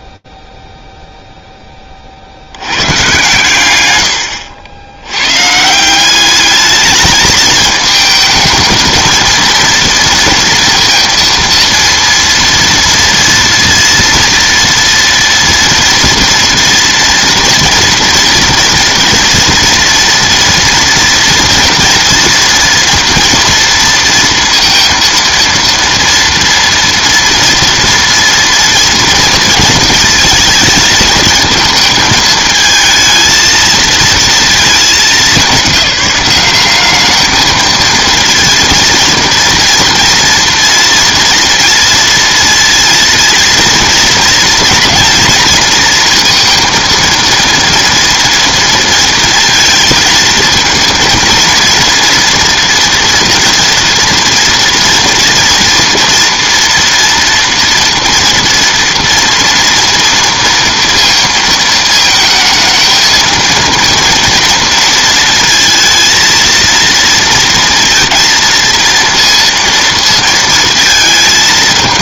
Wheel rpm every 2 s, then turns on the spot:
0, 90, 80, 210, 220, 230, 230, 230, 230, 230, 230, 230, 230, 230, 230, 220, 220, 220, 190, 230, 230, 230, 230, 230, 230, 230, 230, 230, 240, 230, 230, 220, 230, 230, 230, 230.
none